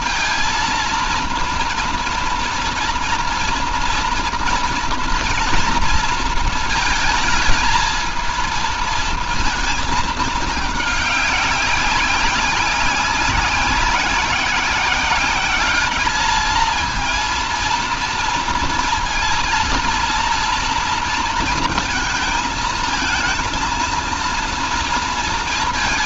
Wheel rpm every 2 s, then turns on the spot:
230, 230, 230, 220, 220, 200, 190, 190, 220, 230, 230, 230, 230.
none